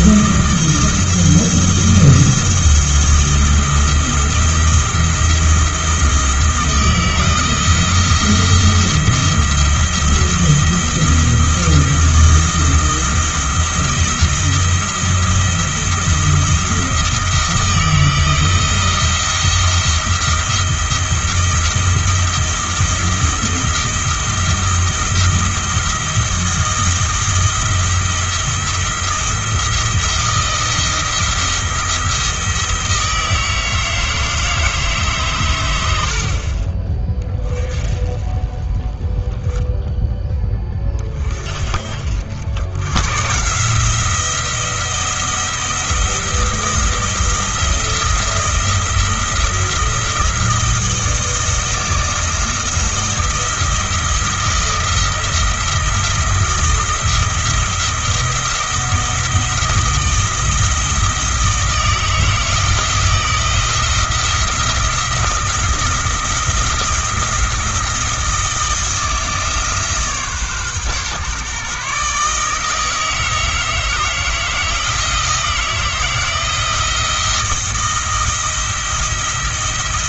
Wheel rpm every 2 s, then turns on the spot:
170, 170, 170, 160, 170, 170, 170, 170, 170, 170, 170, 170, 170, 170, 170, 170, 160, 150, 30, 20, 20, 110, 170, 170, 170, 170, 160, 170, 170, 170, 160, 160, 170, 170, 160, 130, 160, 160, 170, 170.
none